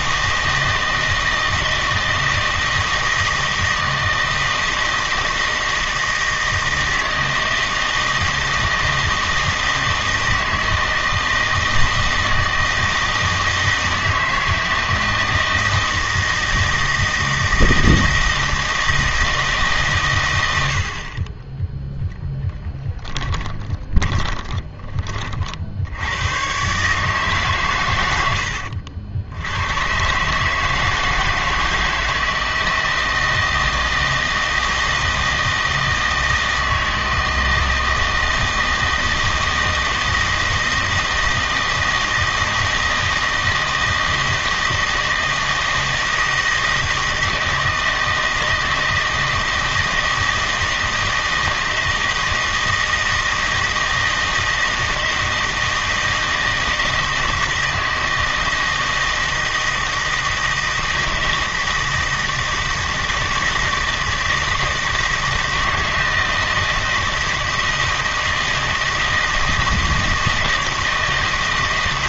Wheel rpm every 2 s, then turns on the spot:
160, 160, 160, 160, 160, 160, 160, 160, 160, 160, 70, 10, 20, 140, 80, 160, 160, 160, 160, 160, 160, 160, 160, 160, 160, 160, 160, 160, 160, 160, 160, 160, 160, 160, 160, 160.
22-24